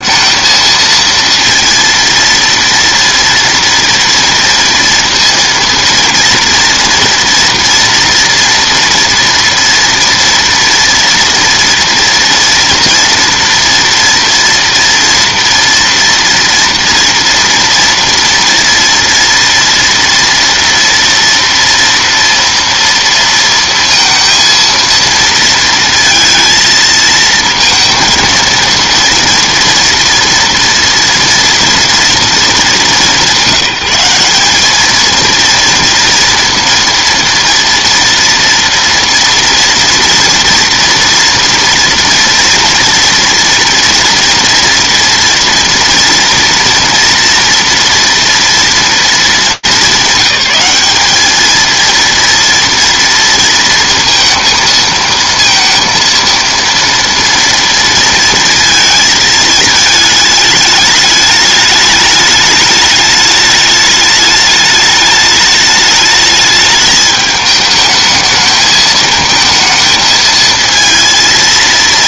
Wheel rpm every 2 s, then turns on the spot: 230, 230, 230, 230, 230, 230, 230, 230, 230, 230, 230, 230, 230, 220, 220, 230, 230, 190, 230, 230, 230, 230, 230, 230, 230, 200, 230, 230, 230, 230, 220, 210, 210, 210, 220, 220.
none